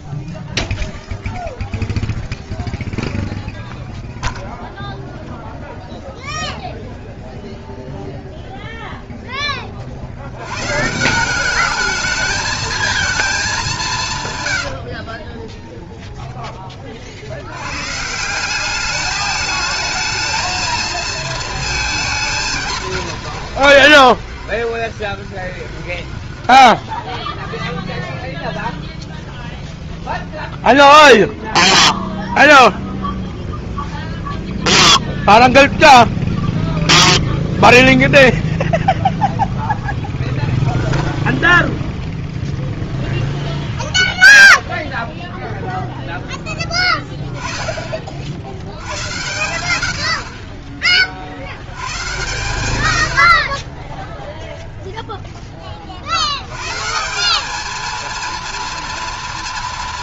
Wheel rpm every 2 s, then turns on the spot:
0, 0, 0, 0, 70, 220, 150, 0, 150, 220, 220, 120, 30, 0, 0, 0, 0, 0, 0, 0, 0, 0, 10, 40, 70, 130, 0, 60, 230, 220.
22-26